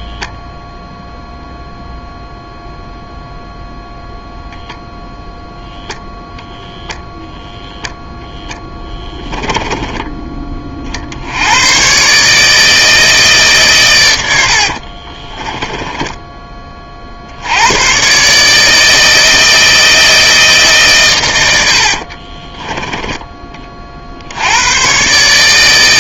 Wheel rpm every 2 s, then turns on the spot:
0, 0, 0, 0, 10, 30, 160, 70, 20, 150, 150, 20, 90.
8-10 22-24